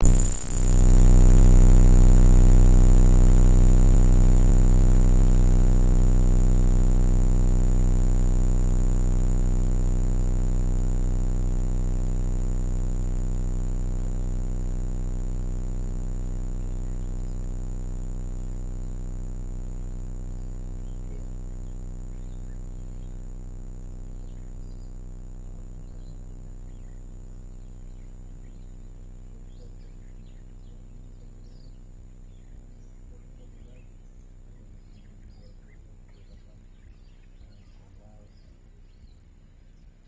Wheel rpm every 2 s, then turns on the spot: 0, 0, 0, 0, 0, 0, 0, 0, 0, 0, 0, 0, 0, 0, 0, 0, 0, 0, 0, 0.
none